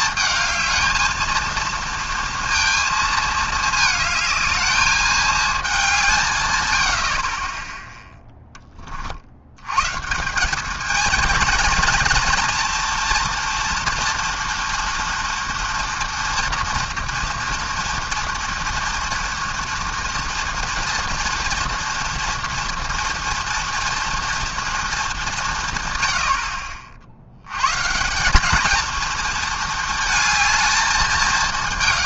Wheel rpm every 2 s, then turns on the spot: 220, 230, 220, 110, 10, 200, 230, 230, 230, 240, 230, 230, 230, 50, 210, 220.
none